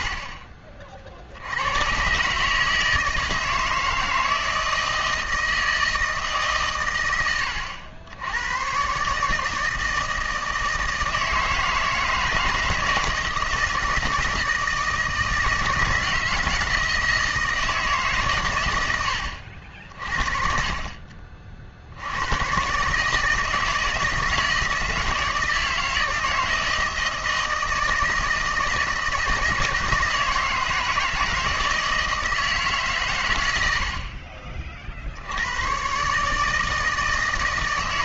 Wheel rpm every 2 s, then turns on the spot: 60, 150, 160, 130, 110, 160, 160, 160, 160, 120, 40, 130, 160, 160, 160, 160, 150, 40, 160.
none